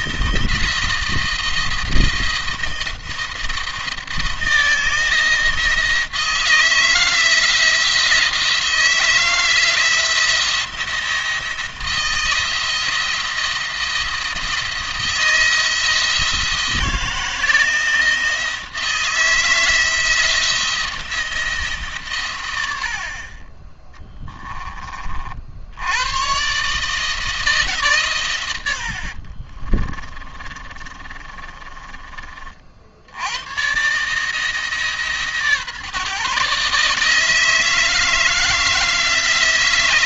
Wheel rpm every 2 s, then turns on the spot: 170, 170, 170, 160, 170, 170, 170, 170, 160, 170, 170, 80, 20, 140, 90, 30, 60, 150, 150, 160.
28-32